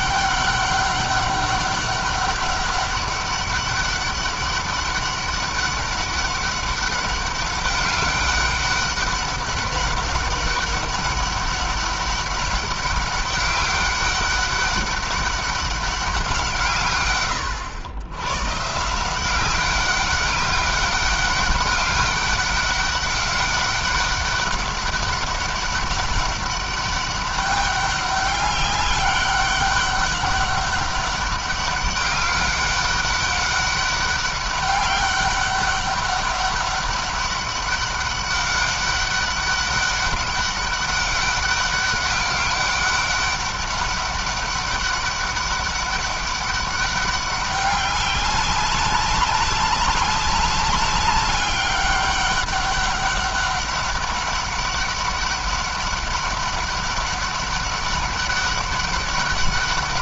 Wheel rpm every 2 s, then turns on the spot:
200, 200, 200, 200, 200, 200, 200, 200, 140, 160, 200, 200, 200, 200, 200, 200, 200, 200, 200, 200, 200, 200, 200, 200, 200, 200, 200, 200, 200, 200.
none